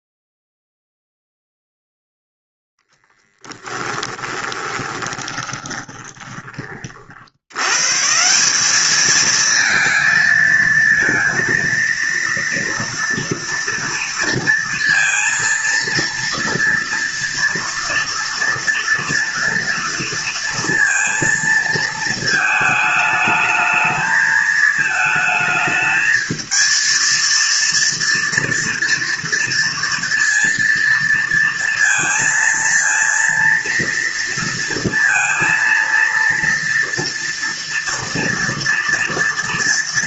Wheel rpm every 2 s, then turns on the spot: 0, 10, 20, 50, 210, 230, 230, 230, 230, 230, 230, 220, 220, 230, 230, 230, 230, 230, 230, 230.
4-6